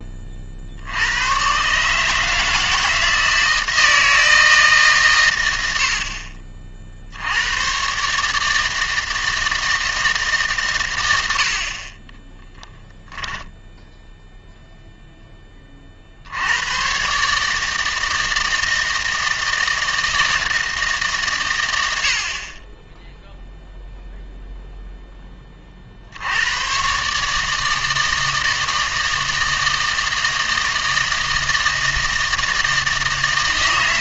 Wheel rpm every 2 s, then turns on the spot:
50, 160, 160, 50, 160, 130, 0, 0, 100, 160, 160, 30, 0, 110, 160, 160, 160.
none